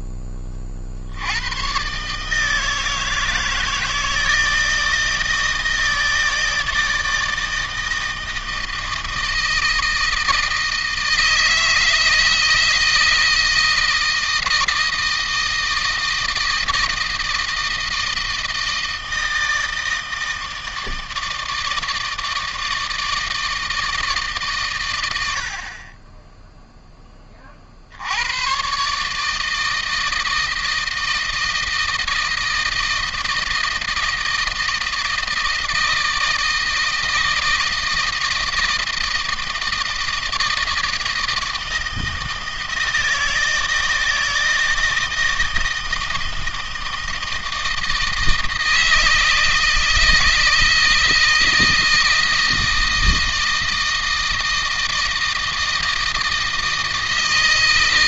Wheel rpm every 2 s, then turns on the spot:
60, 160, 160, 160, 160, 160, 160, 160, 160, 160, 160, 160, 120, 10, 140, 160, 160, 160, 160, 160, 160, 160, 170, 160, 160, 160, 160, 160, 160.
none